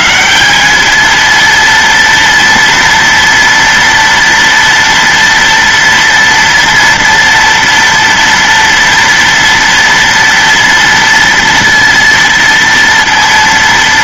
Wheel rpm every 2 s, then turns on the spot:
110, 230, 240, 230, 230, 230, 230.
none